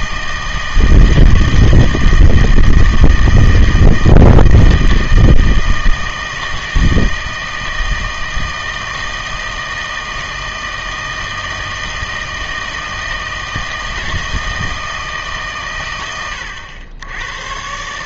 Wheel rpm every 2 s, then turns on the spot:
160, 160, 160, 160, 160, 160, 160, 160, 100.
none